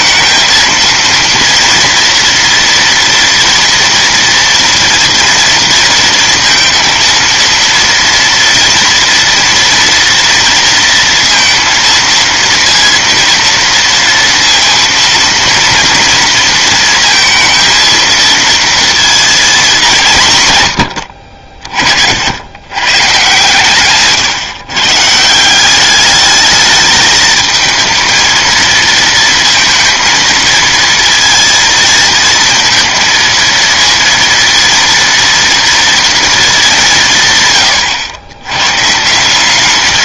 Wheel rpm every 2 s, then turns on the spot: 230, 230, 230, 230, 230, 230, 230, 230, 230, 230, 70, 130, 140, 210, 230, 230, 230, 230, 170, 150.
none